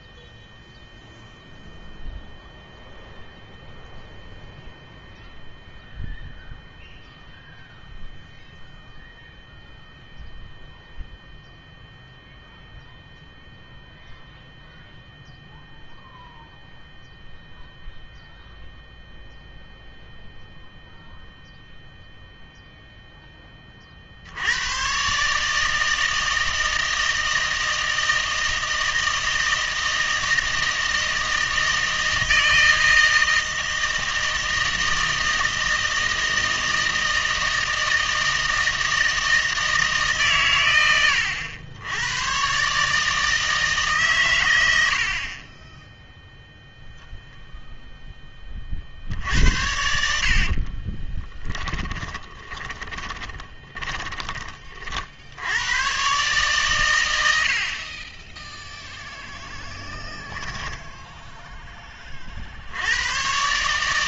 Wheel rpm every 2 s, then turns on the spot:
0, 0, 0, 0, 0, 0, 0, 0, 0, 0, 0, 0, 120, 160, 160, 160, 160, 160, 160, 160, 100, 140, 80, 0, 50, 30, 20, 50, 110, 0, 10, 90.
50-54